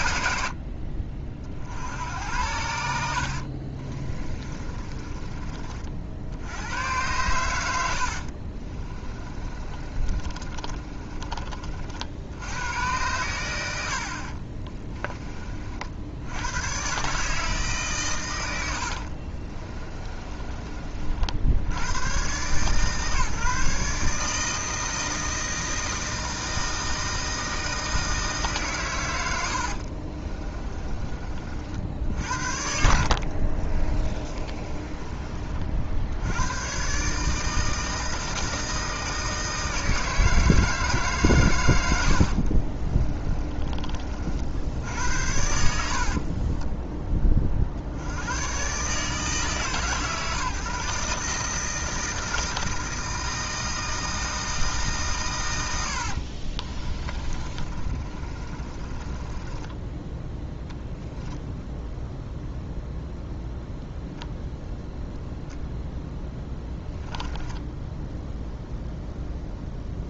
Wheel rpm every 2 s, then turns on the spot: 60, 80, 30, 90, 40, 30, 100, 30, 110, 80, 40, 140, 160, 160, 140, 20, 60, 20, 110, 160, 160, 50, 70, 20, 110, 140, 160, 160, 40, 30, 0, 0, 0, 10, 0.
4-6 8-12 14-16 18-20 30-32 34-36 42-44 46-48 56-60 66-68